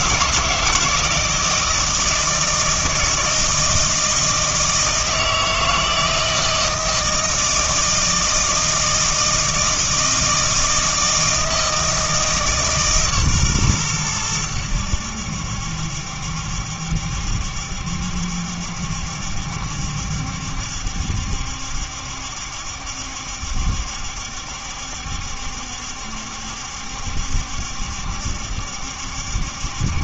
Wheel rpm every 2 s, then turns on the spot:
160, 160, 160, 160, 160, 160, 150, 90, 70, 70, 70, 70, 70, 70, 70.
none